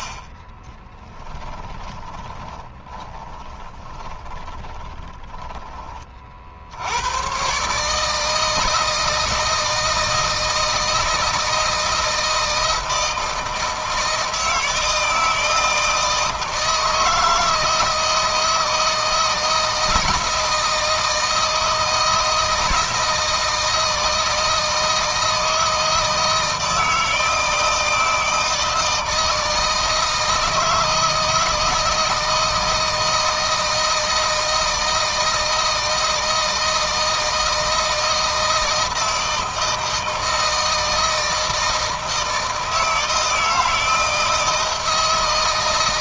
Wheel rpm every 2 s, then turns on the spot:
20, 20, 30, 80, 160, 160, 160, 160, 160, 160, 160, 160, 160, 160, 160, 160, 160, 160, 160, 160, 160, 160, 160.
0-6